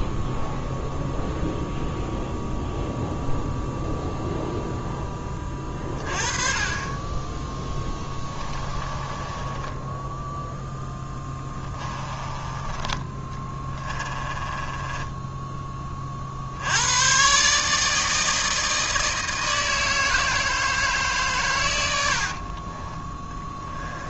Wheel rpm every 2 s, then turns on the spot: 0, 0, 0, 30, 20, 0, 20, 20, 80, 160, 160, 30.
8-10 14-16 22-24